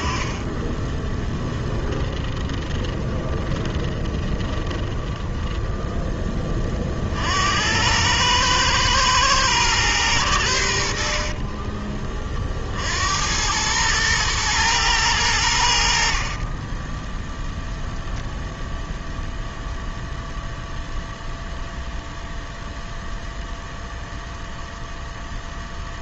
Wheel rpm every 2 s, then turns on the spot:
40, 20, 20, 30, 110, 90, 40, 110, 10, 0, 0, 0, 0.
2-6 16-18